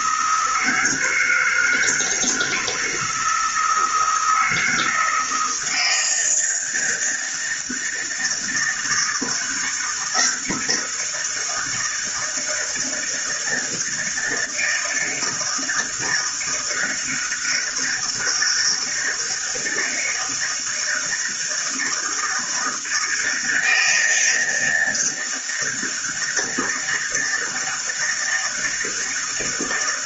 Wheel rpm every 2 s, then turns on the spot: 160, 160, 160, 160, 160, 170, 160, 160, 160, 160, 160, 160, 160, 160, 160.
none